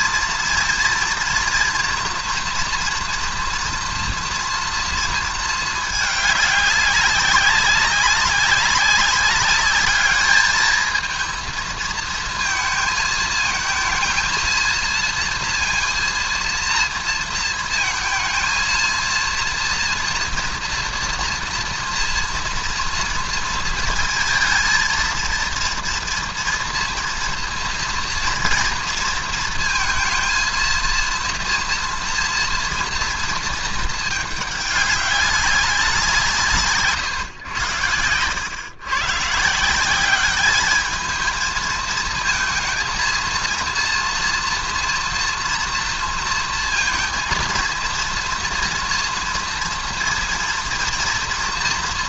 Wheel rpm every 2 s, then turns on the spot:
240, 230, 230, 210, 190, 210, 220, 220, 230, 230, 230, 230, 230, 230, 230, 230, 230, 220, 170, 100, 190, 220, 230, 230, 230, 230.
none